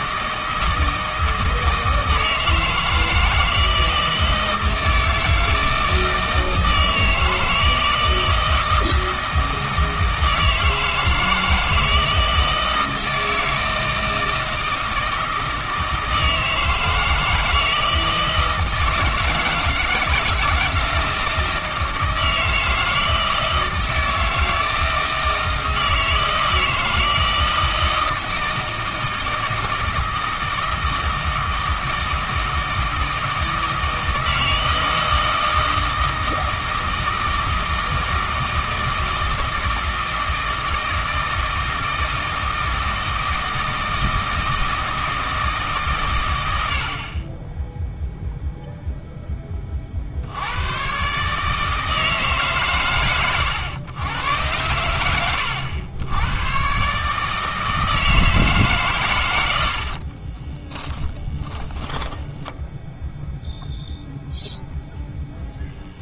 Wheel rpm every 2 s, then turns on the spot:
160, 160, 160, 160, 160, 160, 160, 160, 160, 160, 160, 160, 160, 160, 160, 160, 160, 160, 160, 160, 160, 160, 160, 70, 0, 110, 120, 100, 140, 140, 20, 10, 0.
60-62